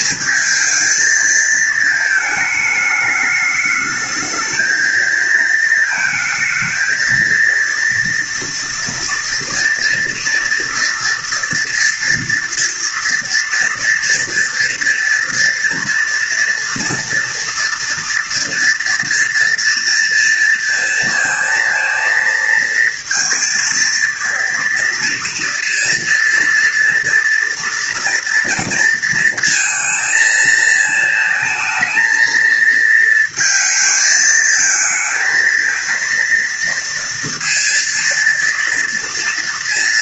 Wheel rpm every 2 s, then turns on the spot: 230, 210, 220, 220, 230, 240, 230, 230, 230, 230, 230, 230, 240, 230, 230, 220, 230, 230, 230, 230.
none